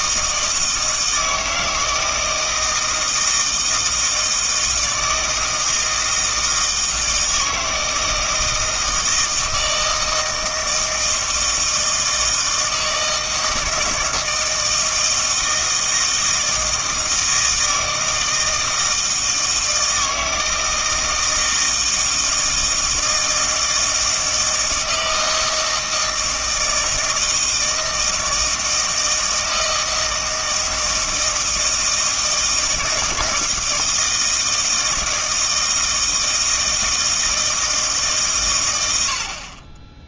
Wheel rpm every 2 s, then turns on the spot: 160, 160, 160, 160, 160, 160, 160, 160, 160, 160, 160, 160, 160, 160, 160, 160, 160, 160, 160, 100.
none